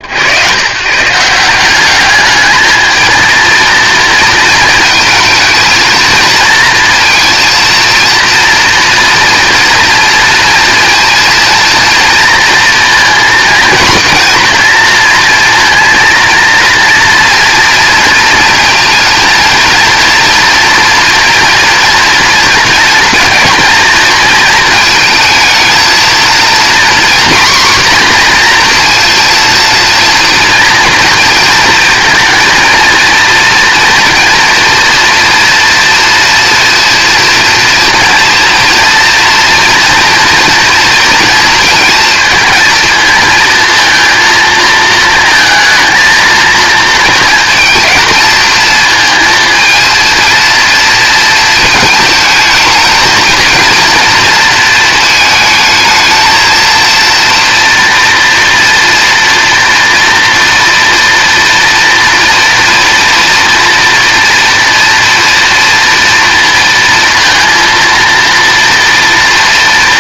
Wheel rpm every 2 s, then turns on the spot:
140, 220, 220, 230, 230, 230, 230, 230, 230, 230, 240, 230, 230, 250, 230, 230, 230, 230, 240, 240, 230, 230, 230, 230, 220, 230, 230, 220, 230, 240, 240, 230, 230, 230, 230.
none